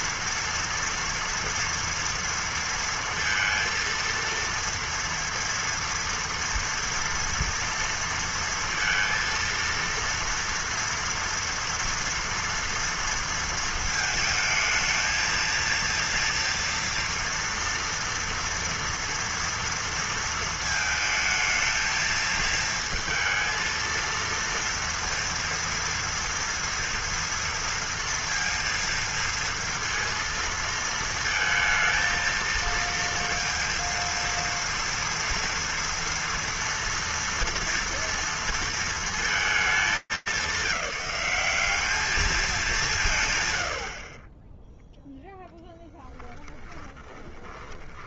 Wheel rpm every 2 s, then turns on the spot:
230, 230, 230, 230, 230, 230, 230, 220, 230, 230, 230, 220, 230, 230, 230, 230, 230, 230, 230, 230, 200, 200, 10, 10.
46-48